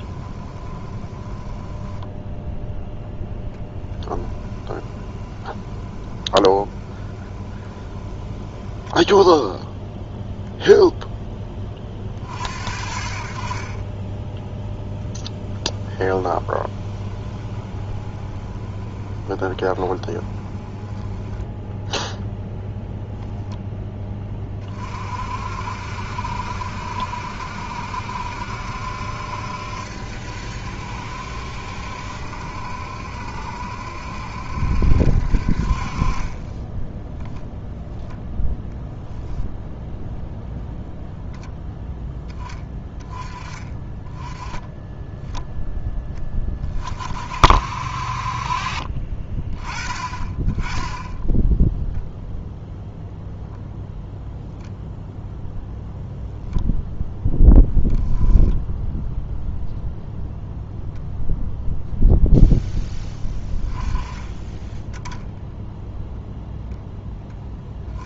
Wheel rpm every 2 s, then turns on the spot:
20, 0, 10, 20, 10, 0, 50, 0, 20, 20, 10, 0, 40, 70, 70, 70, 70, 70, 10, 0, 10, 10, 10, 30, 40, 10, 0, 0, 0, 0, 0, 10, 10, 0.
0-2 4-10 16-20 36-38